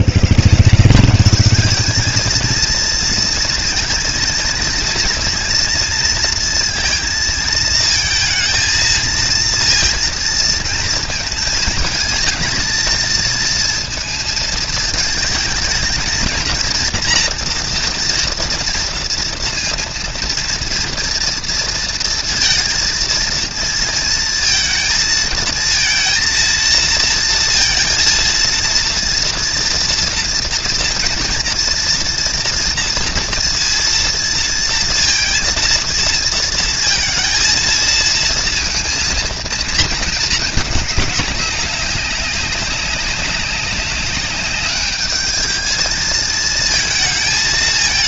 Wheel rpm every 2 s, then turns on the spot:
130, 220, 230, 230, 230, 220, 220, 220, 230, 230, 230, 230, 230, 230, 230, 230, 230, 230, 230, 230, 210, 200, 200, 220.
none